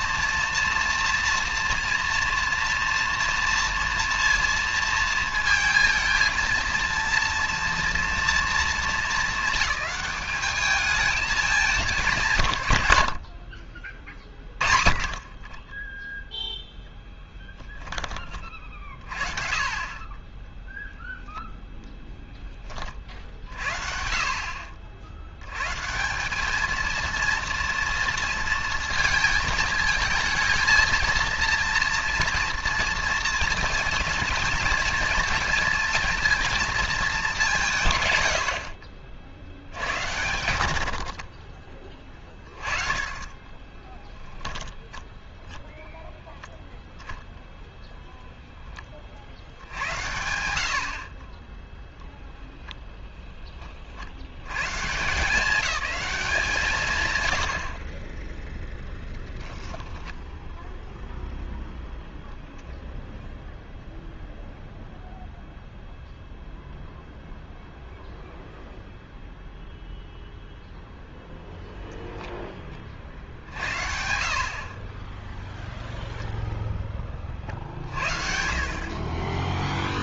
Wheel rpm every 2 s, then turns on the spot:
230, 230, 230, 230, 230, 210, 110, 40, 10, 40, 10, 30, 50, 220, 230, 230, 230, 220, 220, 50, 90, 20, 10, 0, 10, 70, 0, 100, 180, 10, 0, 0, 0, 0, 0, 0, 0, 60, 0, 50.
16-18